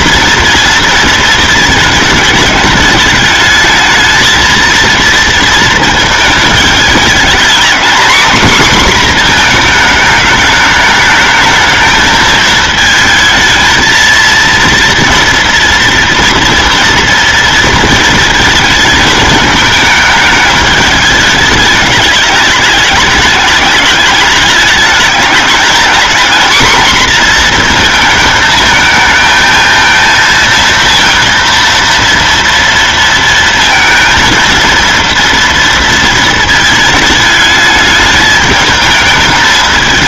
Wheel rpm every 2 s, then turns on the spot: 230, 210, 230, 210, 250, 220, 220, 230, 240, 220, 210, 210, 210, 240, 220, 230, 230, 230, 220, 220.
none